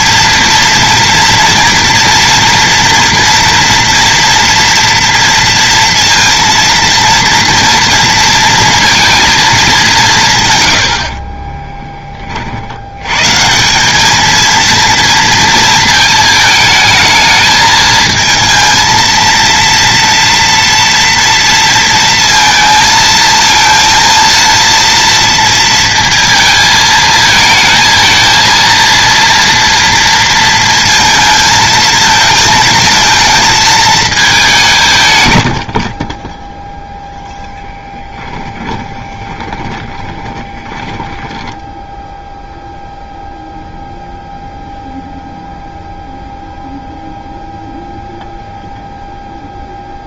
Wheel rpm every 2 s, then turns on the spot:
230, 230, 230, 230, 230, 110, 60, 230, 220, 230, 230, 220, 230, 220, 230, 230, 220, 200, 0, 10, 20, 0, 0, 0, 0.
38-42